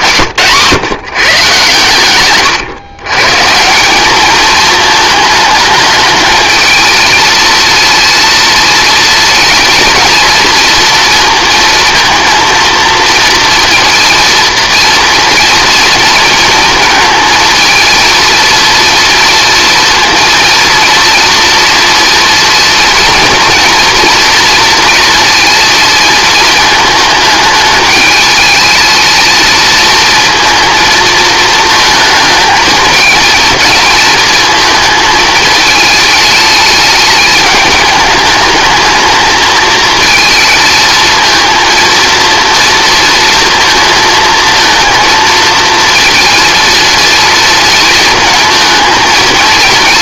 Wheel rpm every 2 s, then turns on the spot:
130, 120, 220, 220, 230, 230, 240, 230, 230, 230, 230, 230, 230, 220, 220, 220, 220, 220, 210, 220, 220, 230, 220, 230, 230.
none